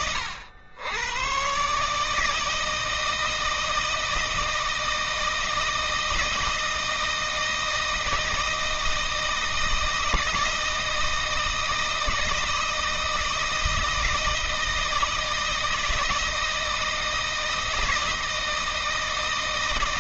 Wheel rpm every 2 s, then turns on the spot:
100, 160, 160, 160, 160, 160, 160, 160, 160, 160.
none